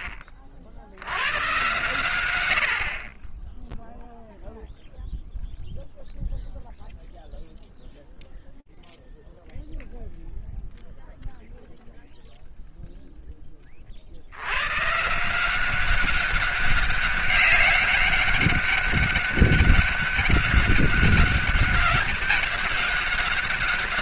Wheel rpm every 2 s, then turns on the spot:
40, 0, 0, 0, 0, 0, 10, 180, 200, 200, 200, 200.
none